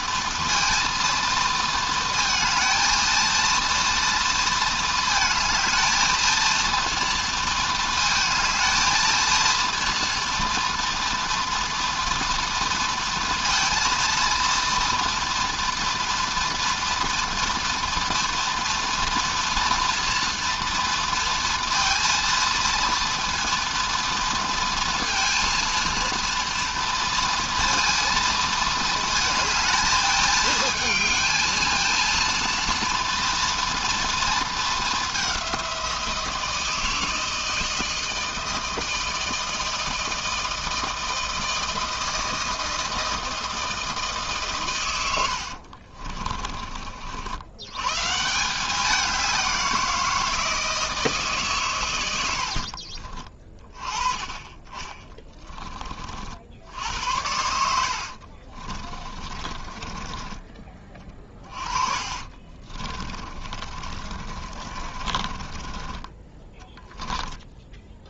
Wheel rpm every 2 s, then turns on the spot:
230, 220, 230, 230, 230, 230, 230, 230, 230, 240, 240, 230, 230, 230, 230, 220, 230, 220, 160, 160, 160, 160, 140, 40, 170, 170, 80, 20, 60, 50, 20, 40, 40, 10.
46-48 52-54 58-66